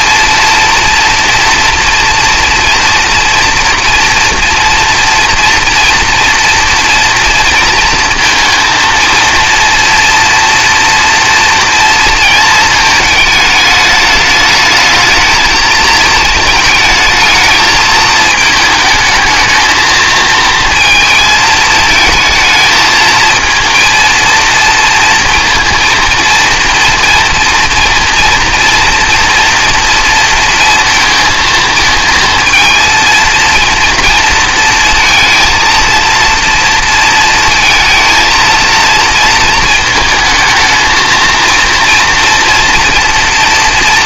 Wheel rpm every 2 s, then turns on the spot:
230, 230, 240, 230, 230, 230, 220, 220, 220, 220, 220, 220, 230, 230, 230, 230, 220, 230, 230, 230, 220, 240.
none